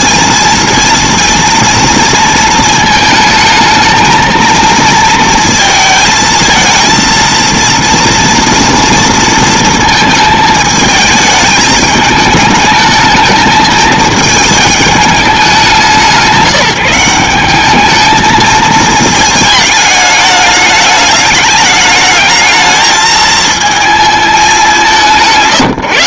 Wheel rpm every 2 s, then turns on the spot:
230, 220, 220, 230, 230, 220, 220, 220, 190, 220, 210, 220, 200.
none